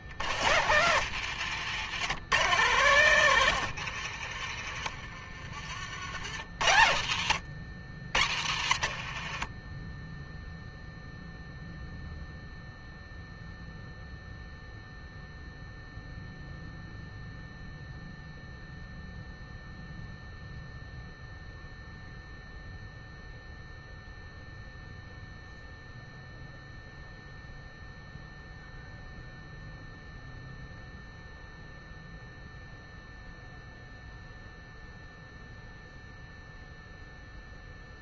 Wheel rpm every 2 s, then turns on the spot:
110, 140, 50, 100, 70, 0, 0, 0, 0, 0, 0, 0, 0, 0, 0, 0, 0, 0, 0.
2-4